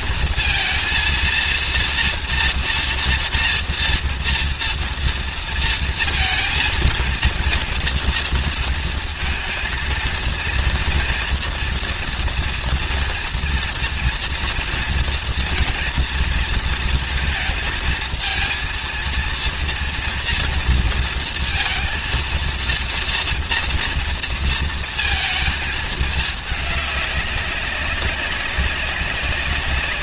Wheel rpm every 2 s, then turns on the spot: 230, 230, 230, 230, 230, 230, 230, 230, 230, 230, 230, 230, 230, 210, 200.
none